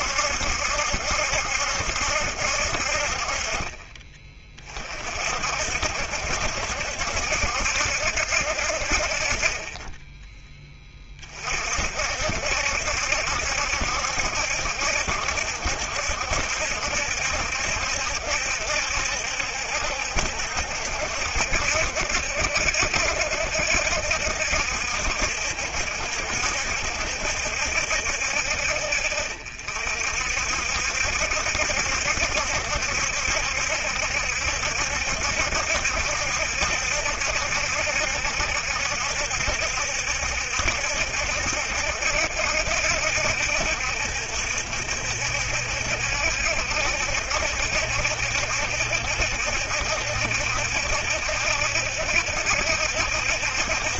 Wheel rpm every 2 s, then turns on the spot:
70, 60, 30, 70, 60, 20, 70, 70, 70, 70, 70, 60, 70, 70, 60, 60, 70, 70, 70, 70, 70, 70, 70, 70, 70, 70, 70.
none